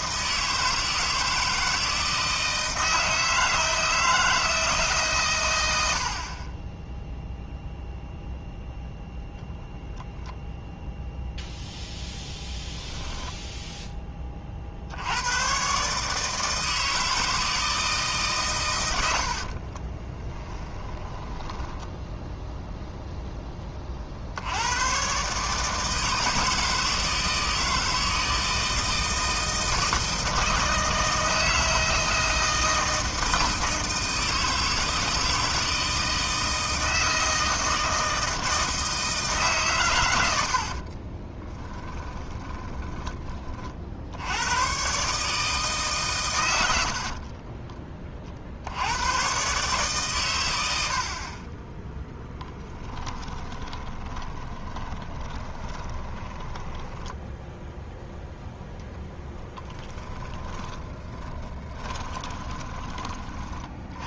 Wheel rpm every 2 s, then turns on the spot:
160, 160, 150, 10, 0, 0, 0, 60, 160, 110, 10, 0, 110, 160, 160, 160, 160, 160, 160, 160, 50, 20, 130, 70, 90, 70, 10, 20, 10, 10, 20, 20.
6-8 20-22 40-44 46-48 52-58 60-62